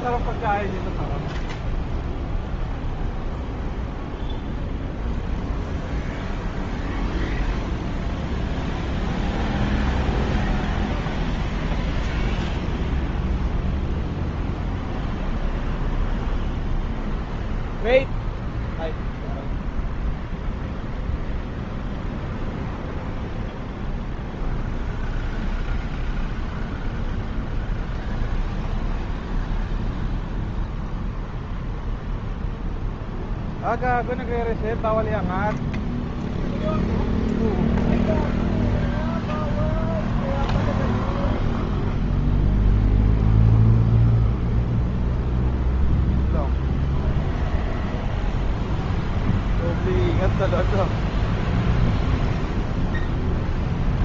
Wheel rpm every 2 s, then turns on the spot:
0, 0, 0, 0, 0, 0, 0, 0, 0, 0, 0, 0, 0, 0, 0, 0, 0, 0, 0, 0, 0, 0, 0, 0, 0, 0, 0.
none